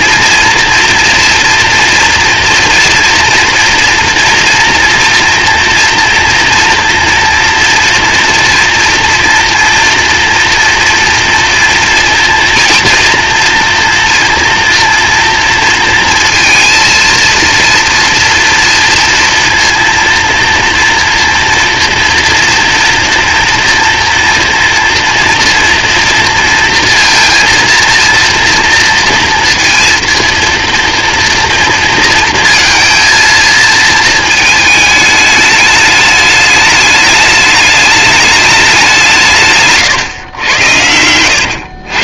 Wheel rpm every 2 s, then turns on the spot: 230, 230, 230, 230, 230, 230, 240, 240, 230, 230, 230, 230, 230, 230, 230, 230, 230, 220, 210, 180, 90.
40-42